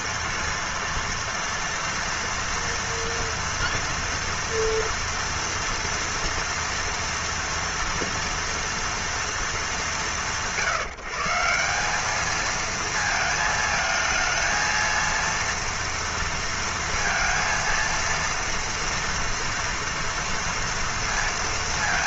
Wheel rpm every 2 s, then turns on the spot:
230, 230, 230, 240, 230, 150, 220, 220, 230, 230, 230.
none